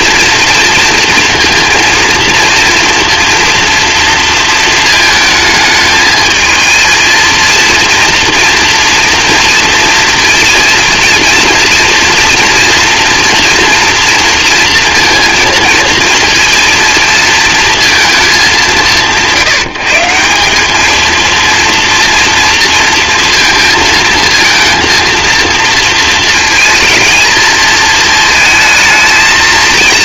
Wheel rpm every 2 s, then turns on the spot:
230, 230, 230, 220, 230, 230, 240, 230, 230, 190, 190, 230, 230, 220, 220.
none